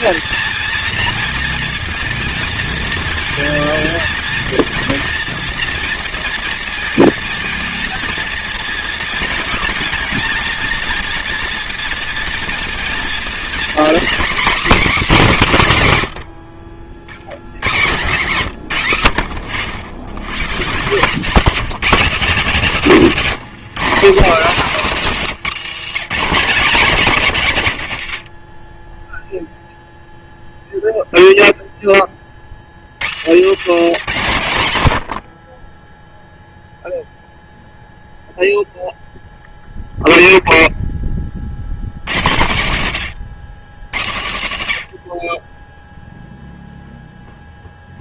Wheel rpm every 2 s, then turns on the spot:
230, 230, 230, 230, 230, 230, 230, 270, 60, 150, 150, 210, 200, 200, 40, 0, 50, 120, 0, 0, 0, 120, 90, 0.
none